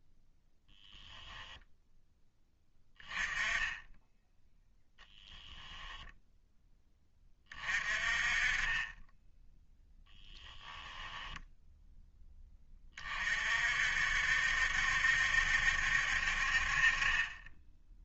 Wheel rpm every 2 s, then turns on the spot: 0, 10, 0, 20, 10, 10, 40, 70, 30.
10-12